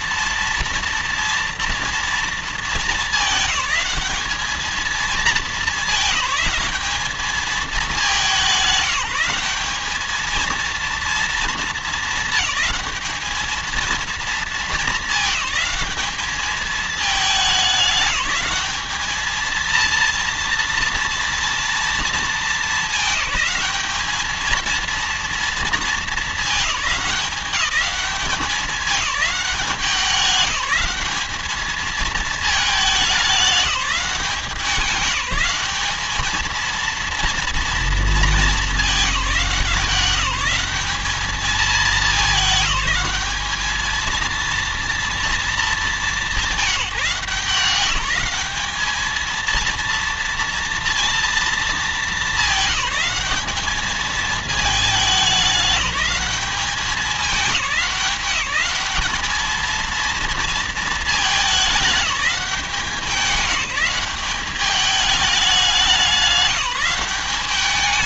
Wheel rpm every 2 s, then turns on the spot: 230, 220, 210, 210, 180, 230, 220, 220, 210, 220, 230, 220, 230, 200, 190, 210, 210, 180, 230, 200, 210, 210, 230, 180, 220, 230, 210, 210, 200, 210, 210, 200, 200, 210.
none